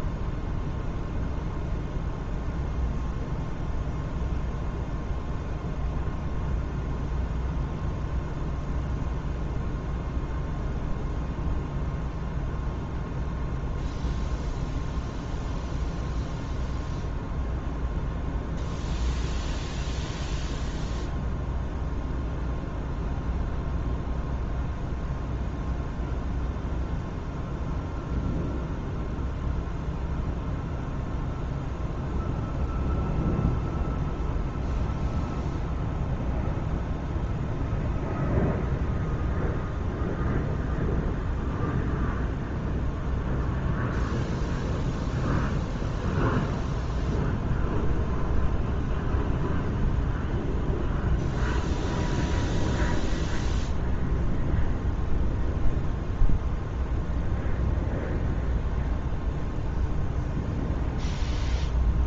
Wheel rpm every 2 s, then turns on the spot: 0, 0, 0, 0, 0, 0, 0, 0, 0, 0, 0, 0, 0, 0, 0, 0, 0, 0, 0, 0, 0, 0, 0, 0, 0, 0, 0, 0, 0, 0, 0.
none